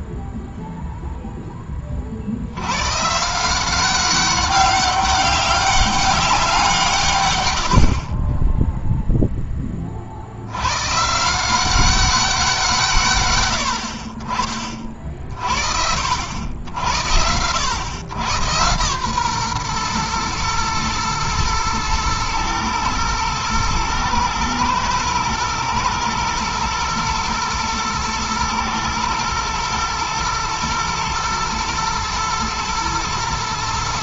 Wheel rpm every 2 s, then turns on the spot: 0, 80, 200, 170, 0, 110, 170, 40, 80, 110, 110, 110, 110, 120, 110, 110, 110.
none